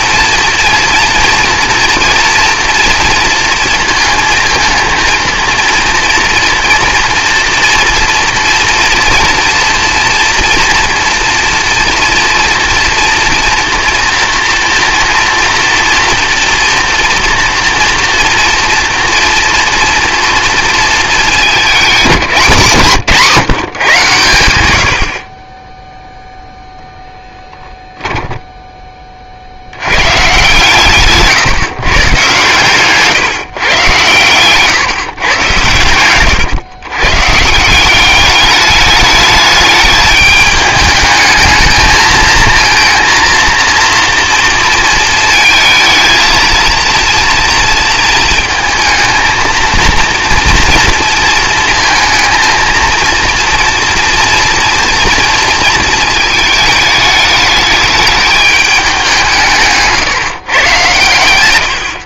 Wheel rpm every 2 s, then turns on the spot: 230, 230, 230, 230, 230, 230, 230, 240, 230, 230, 230, 200, 120, 0, 10, 130, 130, 120, 110, 200, 210, 230, 230, 230, 230, 230, 220, 230, 220, 210, 140.
none